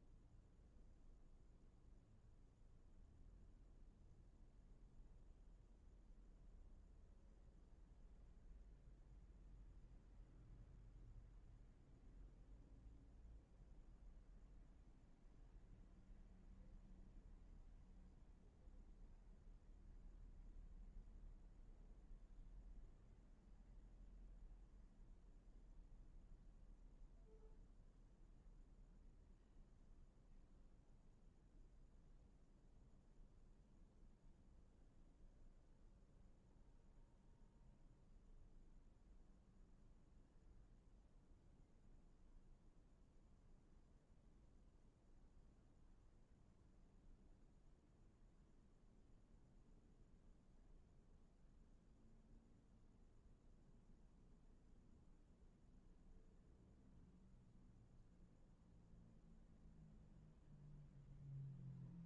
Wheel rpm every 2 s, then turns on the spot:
0, 0, 0, 0, 0, 0, 0, 0, 0, 0, 0, 0, 0, 0, 0, 0, 0, 0, 0, 0, 0, 0, 0, 0, 0, 0, 0, 0, 0, 0, 0.
none